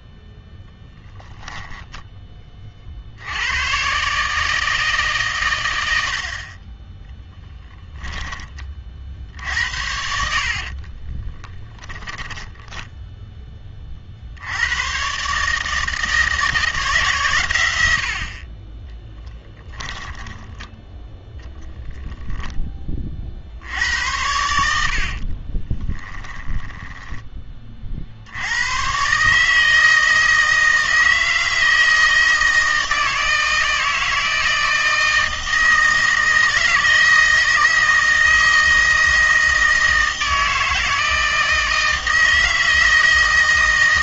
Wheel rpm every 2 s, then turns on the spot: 10, 30, 160, 30, 40, 60, 10, 90, 160, 30, 20, 10, 80, 10, 90, 160, 160, 160, 160, 160, 160, 160.
10-14 20-22 26-28